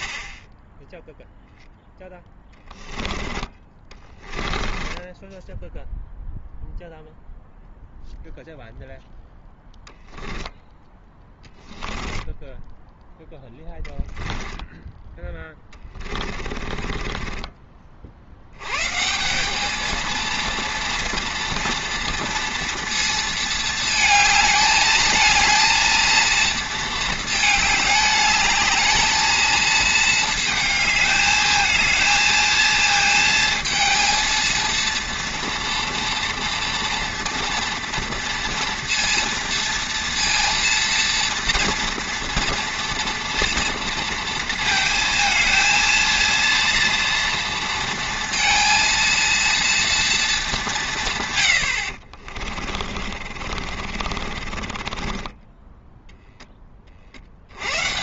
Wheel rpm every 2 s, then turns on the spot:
10, 10, 10, 0, 0, 10, 10, 10, 40, 100, 230, 230, 220, 230, 210, 220, 220, 230, 230, 230, 230, 230, 230, 230, 230, 200, 40, 30, 20.
4-6 12-18 52-56